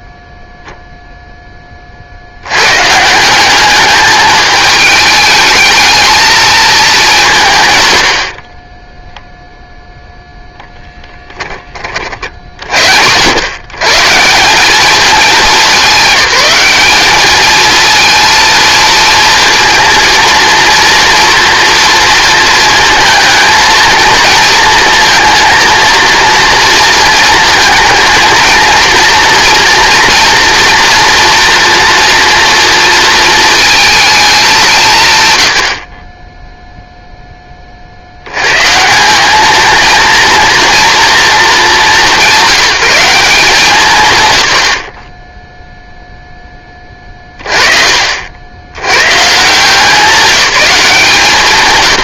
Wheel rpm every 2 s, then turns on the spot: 0, 130, 220, 220, 20, 10, 80, 200, 210, 230, 230, 220, 230, 230, 230, 230, 230, 200, 0, 170, 230, 180, 50, 30, 110, 180.
10-12